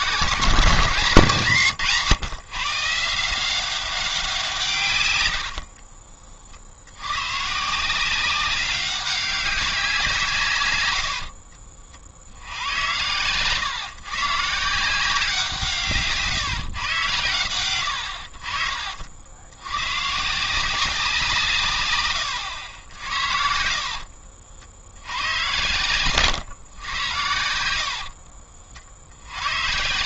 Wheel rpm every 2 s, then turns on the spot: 170, 140, 140, 70, 190, 110, 90, 160, 130, 60, 180, 80, 80, 120, 50.
18-20